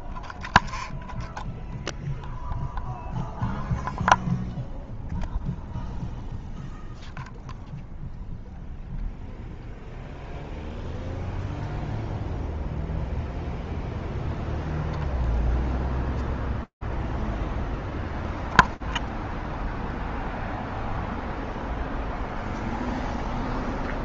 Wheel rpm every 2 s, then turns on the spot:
0, 0, 0, 0, 0, 0, 0, 0, 0, 0, 0, 0.
none